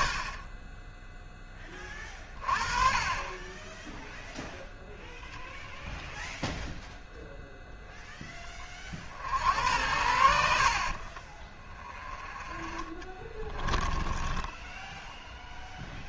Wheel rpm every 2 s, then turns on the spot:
30, 40, 0, 0, 20, 60, 30, 0.
12-14